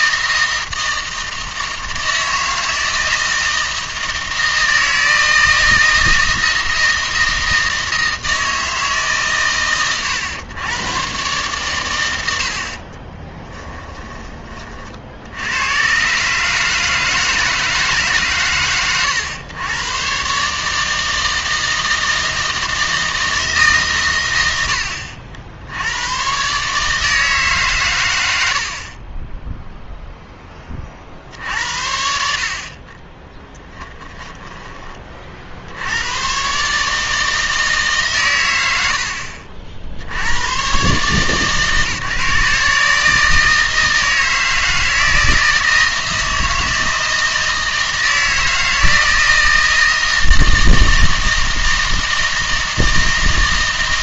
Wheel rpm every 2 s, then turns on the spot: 160, 160, 160, 160, 150, 120, 40, 40, 150, 120, 160, 160, 80, 150, 40, 40, 20, 20, 150, 80, 130, 150, 160, 160, 160, 160, 160.
12-14 32-34